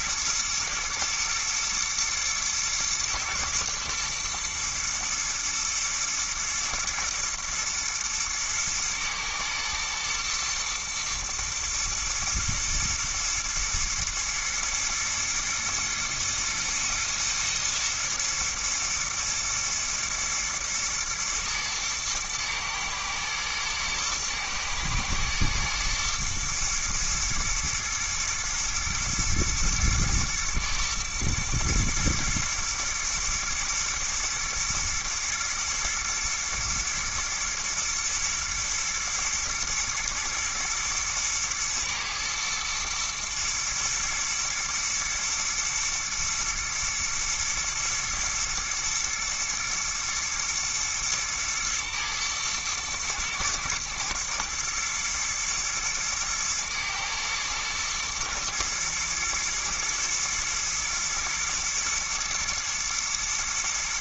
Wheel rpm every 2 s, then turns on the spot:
110, 120, 120, 110, 110, 120, 120, 110, 110, 110, 110, 110, 120, 120, 110, 110, 120, 120, 110, 110, 110, 110, 120, 120, 110, 120, 110, 110, 110, 120, 110, 120.
none